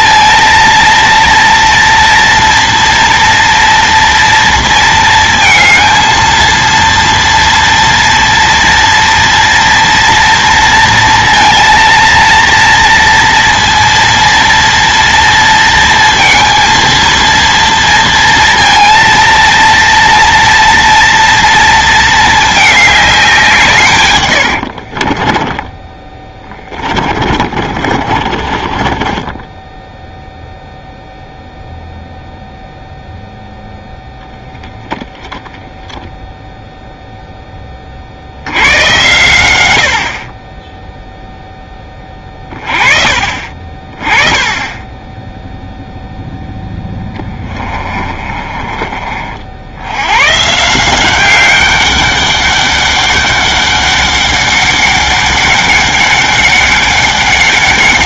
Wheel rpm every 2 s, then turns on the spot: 230, 230, 230, 230, 230, 230, 230, 230, 230, 230, 230, 220, 70, 20, 30, 0, 0, 0, 0, 90, 10, 30, 20, 10, 30, 150, 200, 200, 200.
24-30 46-48